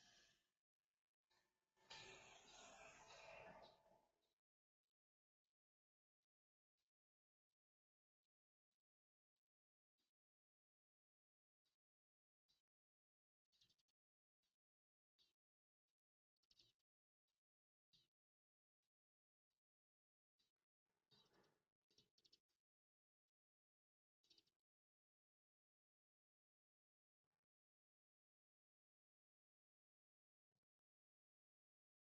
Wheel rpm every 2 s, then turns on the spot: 0, 0, 0, 0, 0, 0, 0, 0, 0, 0, 0, 0, 0, 0, 0, 0.
none